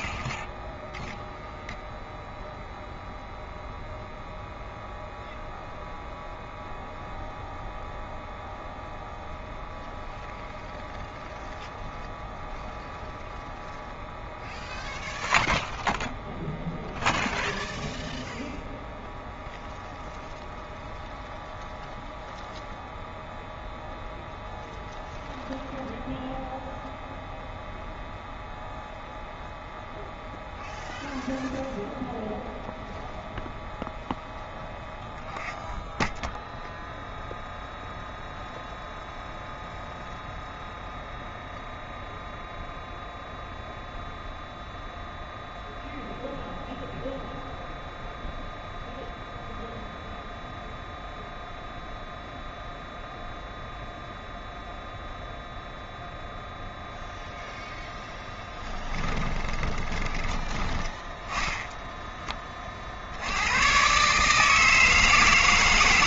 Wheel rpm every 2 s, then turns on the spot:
0, 0, 0, 0, 0, 0, 0, 0, 0, 0, 0, 0, 0, 0, 0, 0, 0, 0, 0, 0, 0, 0, 0, 0, 0, 0, 0, 0, 0, 10, 20, 30, 160.
58-62